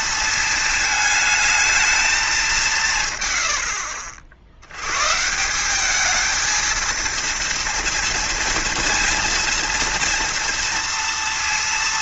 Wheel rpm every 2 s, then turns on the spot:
220, 160, 100, 230, 230, 230.
none